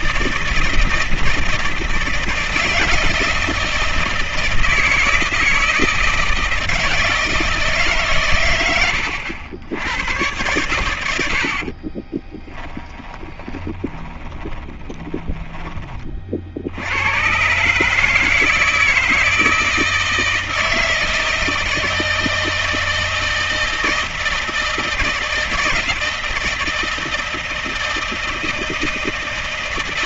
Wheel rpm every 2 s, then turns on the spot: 160, 160, 160, 160, 100, 110, 30, 20, 70, 160, 160, 160, 160, 160, 160.
12-16